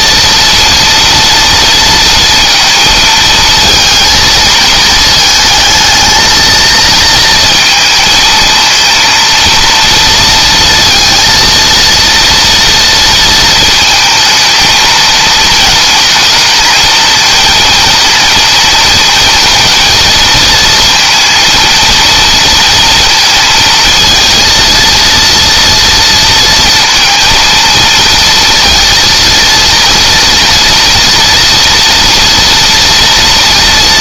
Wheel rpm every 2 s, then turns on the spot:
230, 220, 220, 230, 230, 230, 230, 230, 230, 230, 230, 230, 230, 230, 230, 230, 230.
none